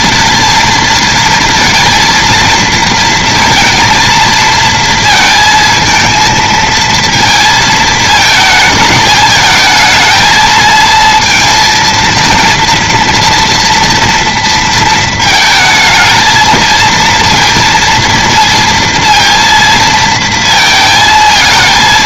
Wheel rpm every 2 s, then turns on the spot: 220, 230, 230, 230, 220, 220, 230, 230, 230, 230, 220.
none